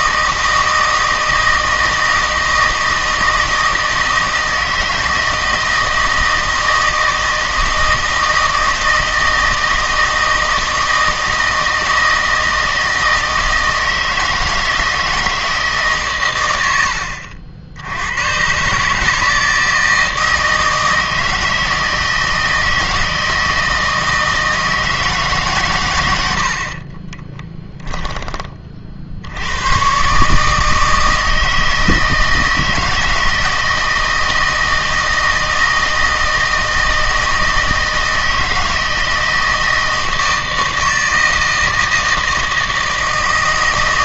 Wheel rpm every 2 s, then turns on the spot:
160, 160, 160, 160, 160, 160, 160, 160, 90, 140, 160, 160, 160, 50, 30, 150, 160, 160, 160, 160, 160, 160.
26-28